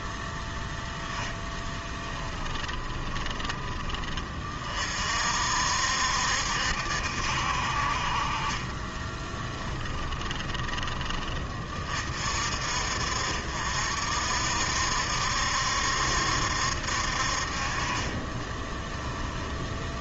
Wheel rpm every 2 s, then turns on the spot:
0, 30, 40, 70, 30, 20, 50, 60, 70, 20.
2-4 8-10 18-20